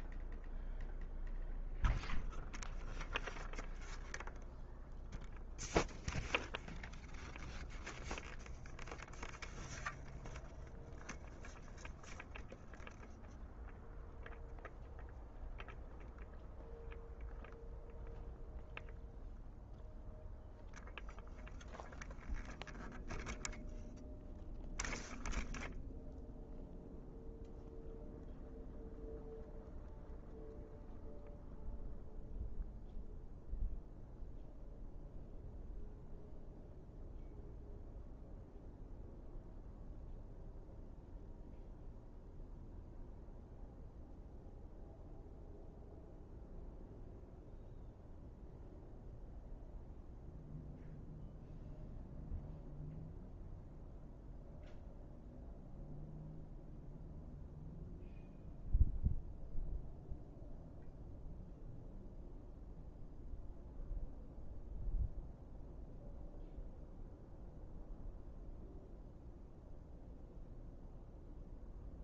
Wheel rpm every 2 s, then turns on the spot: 0, 0, 0, 0, 0, 0, 0, 0, 0, 0, 0, 0, 0, 0, 0, 0, 0, 0, 0, 0, 0, 0, 0, 0, 0, 0, 0, 0, 0, 0, 0, 0, 0, 0, 0, 0.
none